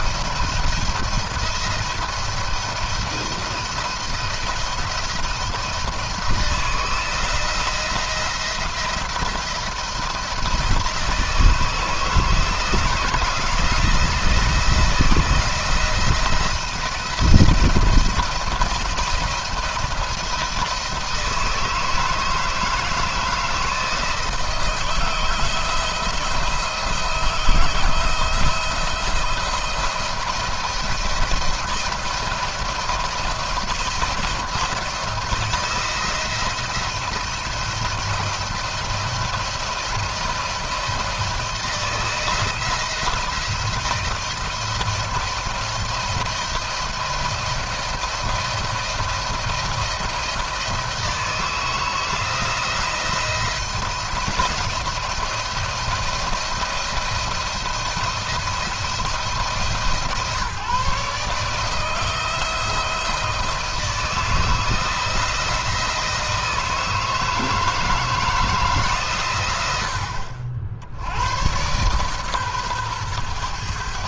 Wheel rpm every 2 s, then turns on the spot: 170, 170, 170, 170, 170, 160, 160, 170, 170, 160, 160, 160, 160, 170, 160, 170, 170, 170, 170, 170, 170, 170, 170, 170, 170, 170, 160, 160, 170, 170, 150, 170, 170, 160, 150, 60, 120.
none